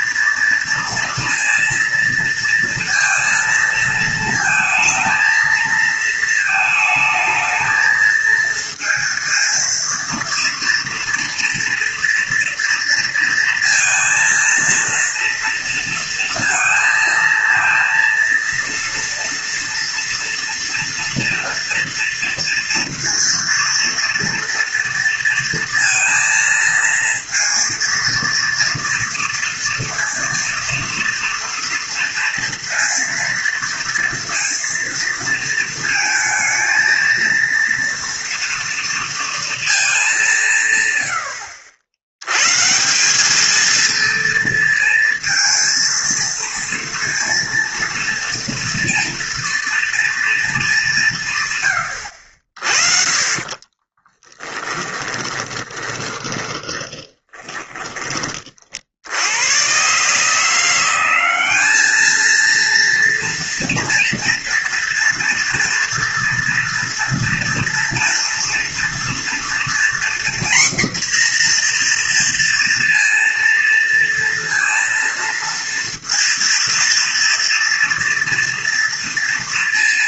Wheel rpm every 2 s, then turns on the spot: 230, 230, 230, 220, 230, 230, 230, 230, 230, 230, 230, 230, 230, 230, 230, 230, 230, 230, 230, 230, 120, 170, 230, 230, 230, 190, 40, 10, 20, 70, 180, 230, 230, 230, 230, 250, 230, 230, 230, 230.
54-58